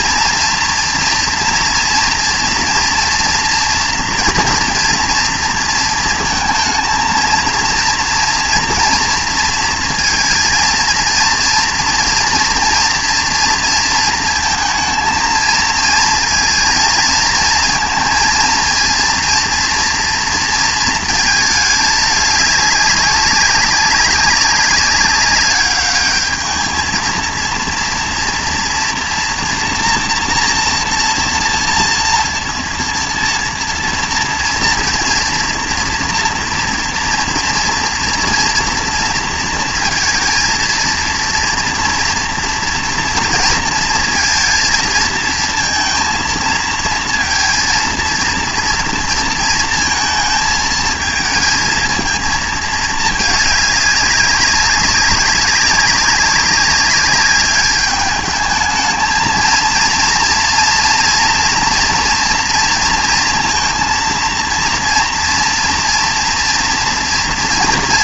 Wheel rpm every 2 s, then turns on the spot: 240, 230, 230, 230, 230, 230, 230, 220, 230, 230, 230, 210, 200, 210, 230, 230, 230, 230, 230, 230, 230, 230, 230, 220, 230, 220, 220, 190, 200, 210, 230, 230, 230, 240.
none